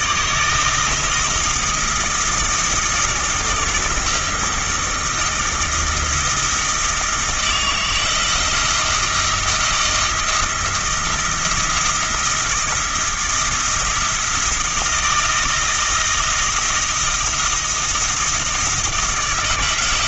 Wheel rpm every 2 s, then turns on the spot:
160, 160, 160, 160, 160, 160, 170, 170, 170, 160.
none